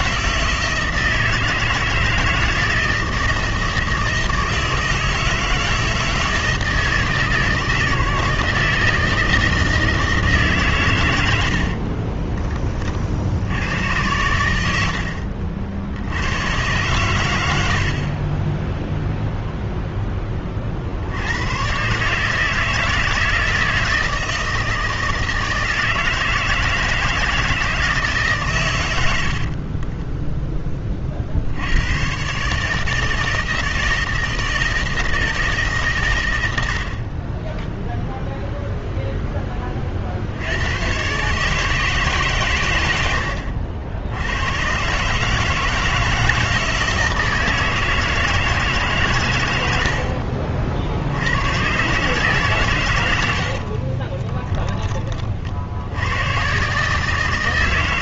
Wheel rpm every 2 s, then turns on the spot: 170, 160, 160, 160, 160, 140, 30, 90, 110, 10, 50, 160, 160, 160, 100, 10, 150, 160, 80, 0, 90, 120, 120, 160, 150, 60, 130, 10, 130.
none